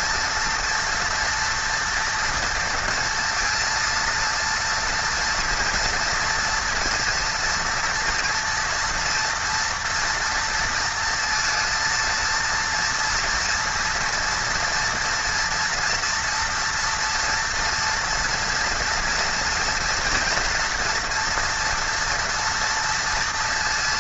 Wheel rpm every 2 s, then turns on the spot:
230, 230, 230, 240, 230, 230, 230, 230, 230, 230, 240, 230.
none